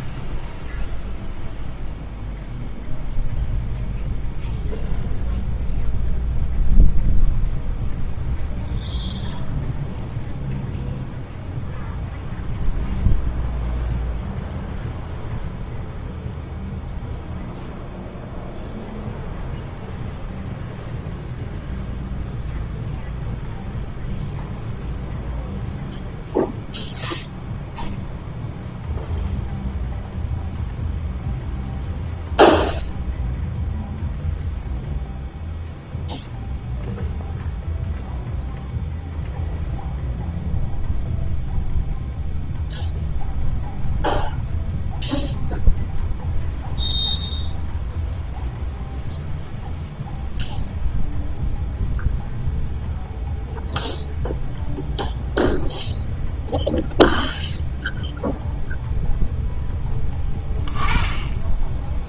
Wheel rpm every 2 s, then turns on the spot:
0, 0, 0, 0, 0, 0, 0, 0, 0, 0, 0, 0, 0, 0, 0, 0, 0, 0, 0, 0, 0, 0, 0, 0, 0, 0, 0, 0, 0, 0, 10.
none